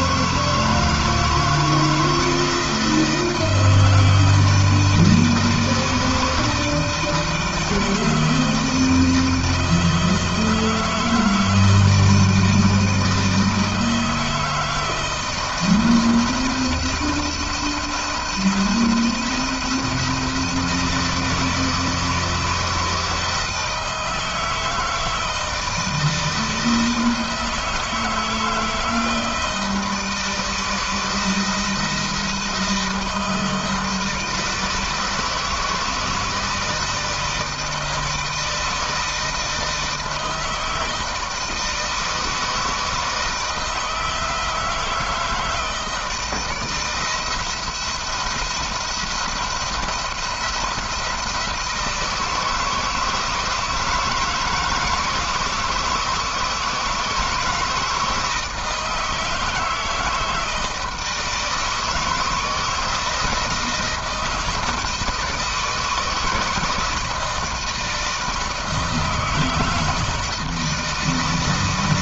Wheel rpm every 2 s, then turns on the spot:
160, 160, 160, 160, 160, 160, 160, 160, 170, 170, 160, 160, 160, 160, 160, 160, 160, 160, 160, 160, 160, 160, 160, 170, 170, 170, 160, 160, 160, 160, 160, 160, 160, 160, 160, 160.
none